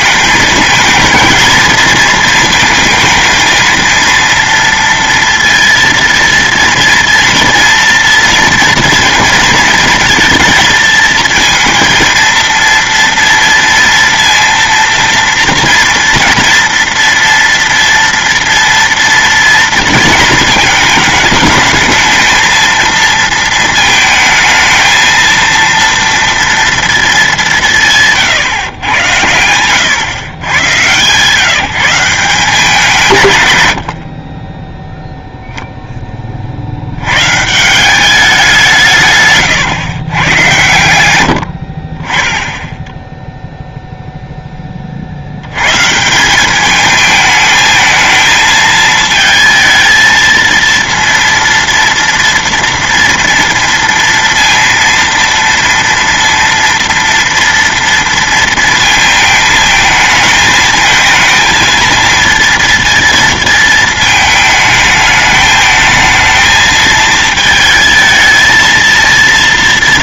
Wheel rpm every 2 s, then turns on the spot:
220, 230, 230, 230, 230, 220, 230, 230, 230, 230, 220, 220, 220, 230, 120, 130, 180, 10, 70, 170, 110, 10, 30, 210, 220, 230, 230, 230, 230, 230, 220, 230, 220, 220, 230.
none